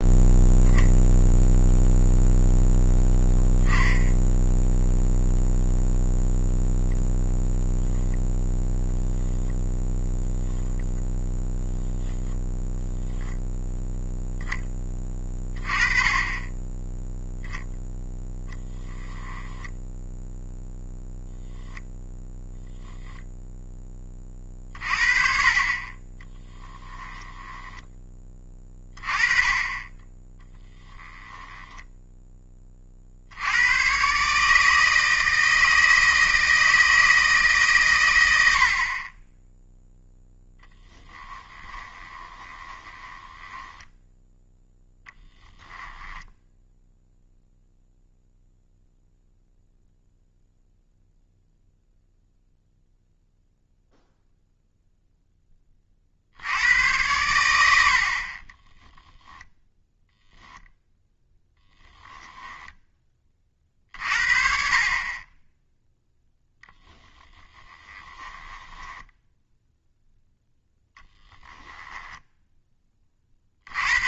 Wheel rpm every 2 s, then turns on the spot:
0, 0, 0, 0, 0, 10, 10, 30, 10, 10, 10, 0, 40, 10, 30, 20, 40, 160, 160, 30, 10, 20, 10, 0, 0, 0, 0, 0, 100, 10, 10, 10, 40, 10, 10, 0, 10.
18-20 26-28 30-32 40-44 58-60 68-70